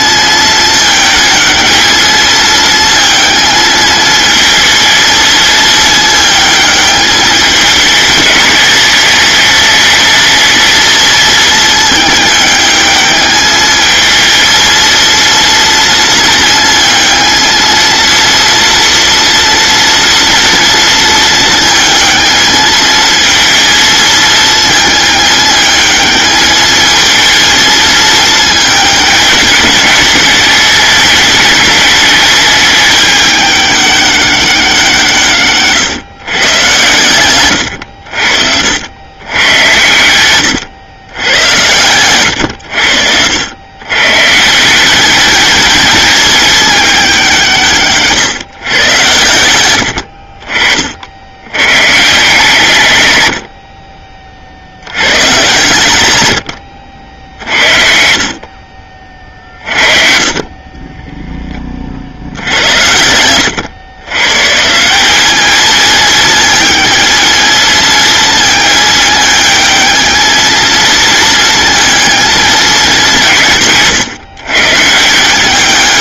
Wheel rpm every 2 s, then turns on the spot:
220, 220, 220, 210, 200, 220, 210, 230, 230, 230, 230, 220, 220, 220, 220, 210, 210, 180, 110, 90, 100, 90, 180, 210, 120, 50, 90, 70, 60, 40, 20, 80, 150, 220, 220, 230, 210, 150.
56-58 60-62